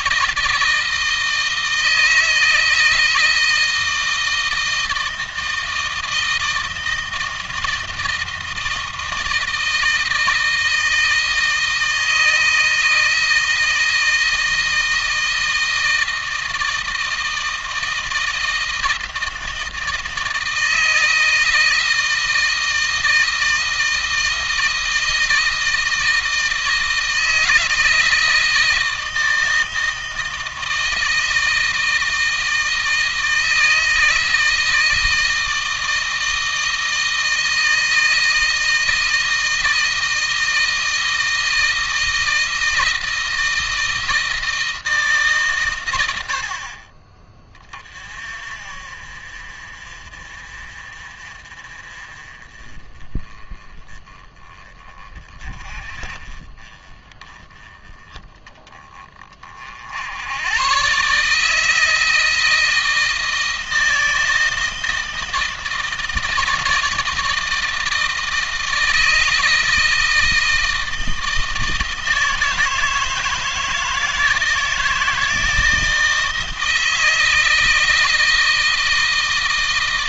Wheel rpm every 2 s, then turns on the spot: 160, 160, 160, 160, 160, 160, 160, 160, 160, 160, 160, 160, 160, 160, 160, 160, 160, 160, 160, 160, 160, 160, 160, 40, 40, 40, 30, 20, 20, 20, 120, 160, 160, 160, 160, 160, 160, 160, 160, 160.
none